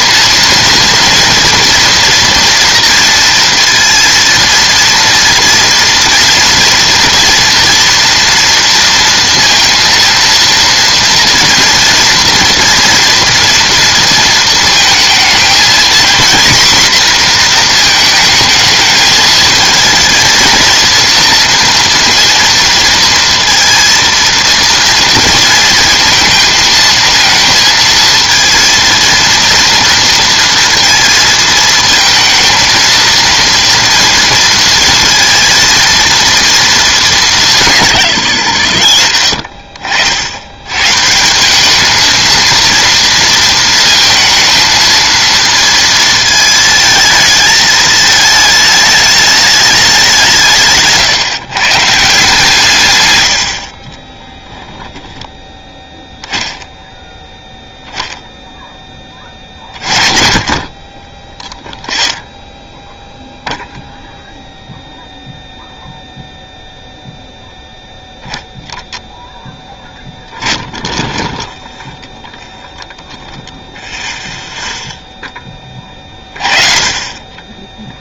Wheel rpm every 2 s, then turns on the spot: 230, 230, 230, 230, 230, 230, 230, 220, 250, 220, 230, 230, 230, 230, 230, 230, 230, 230, 230, 100, 100, 230, 230, 220, 220, 170, 140, 10, 10, 0, 30, 10, 0, 0, 0, 0, 0, 0, 40.
none